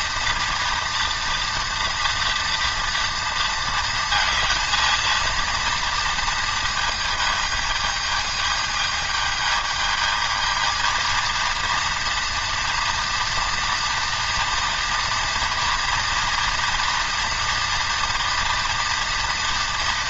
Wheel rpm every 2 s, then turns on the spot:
230, 240, 230, 230, 220, 230, 240, 230, 230, 230.
none